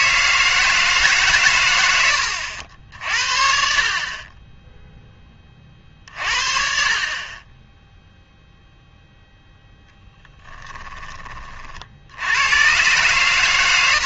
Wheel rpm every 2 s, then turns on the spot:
160, 70, 10, 50, 0, 10, 110.
none